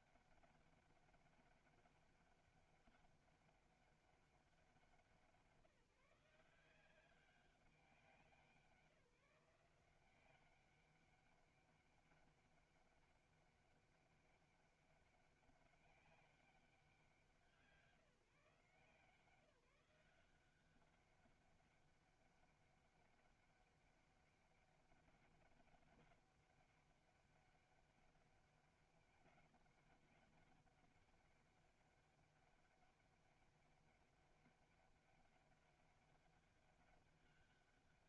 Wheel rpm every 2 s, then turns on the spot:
200, 200, 190, 180, 170, 190, 200, 200, 190, 160, 190, 200, 200, 200, 200, 200, 200, 190, 200.
none